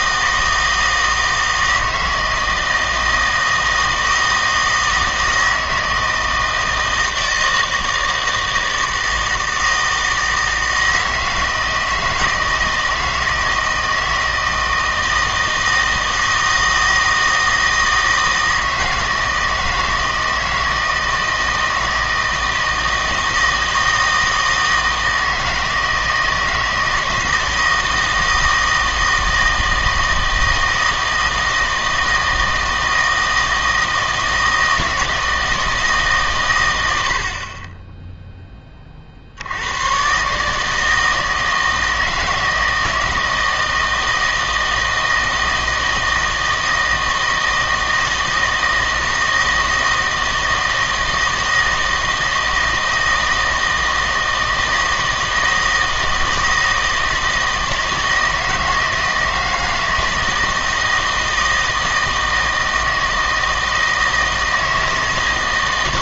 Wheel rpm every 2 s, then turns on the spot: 160, 160, 160, 160, 160, 160, 160, 160, 160, 160, 160, 160, 160, 160, 160, 160, 160, 160, 90, 30, 160, 160, 160, 160, 160, 160, 160, 160, 160, 160, 160, 160, 160.
none